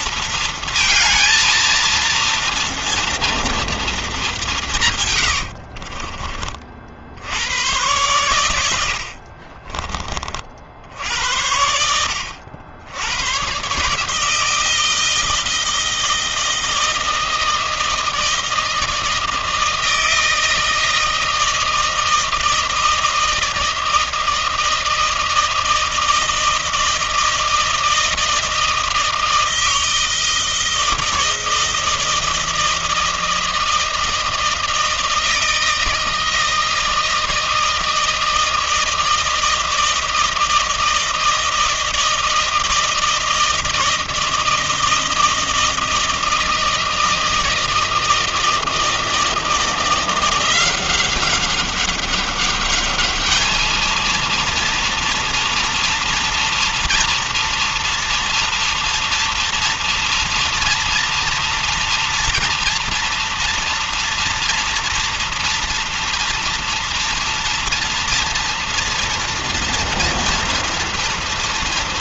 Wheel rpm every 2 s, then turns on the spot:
230, 230, 200, 40, 100, 40, 70, 150, 160, 160, 160, 160, 160, 160, 160, 160, 160, 160, 160, 160, 160, 160, 160, 160, 160, 170, 200, 230, 230, 230, 230, 230, 230, 230, 230, 230.
none